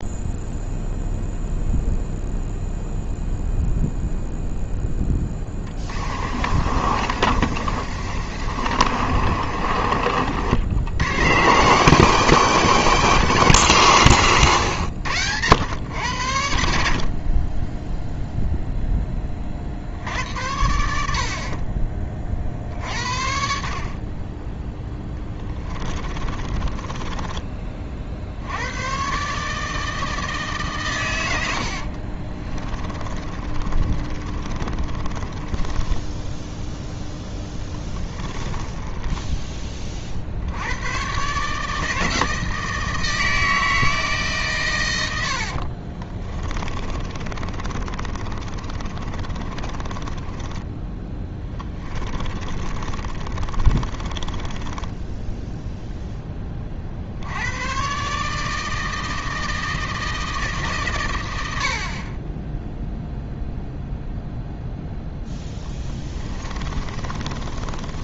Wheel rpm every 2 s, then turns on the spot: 0, 0, 10, 50, 60, 100, 200, 100, 60, 10, 90, 50, 10, 20, 110, 130, 20, 20, 0, 10, 90, 160, 110, 40, 40, 10, 30, 20, 40, 160, 140, 0, 0, 30.
6-10 26-28 32-36 38-40 46-50 52-56 66-68